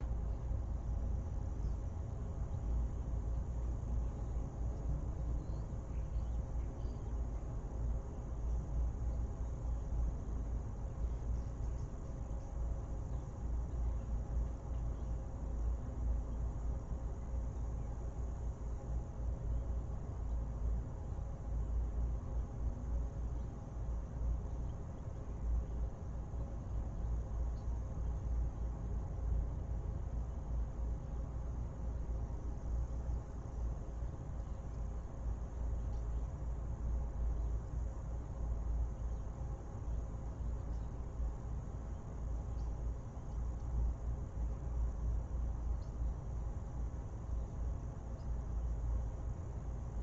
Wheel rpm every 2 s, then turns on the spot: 0, 0, 0, 0, 0, 0, 0, 0, 0, 0, 0, 0, 0, 0, 0, 0, 0, 0, 0, 0, 0, 0, 0, 0, 0.
none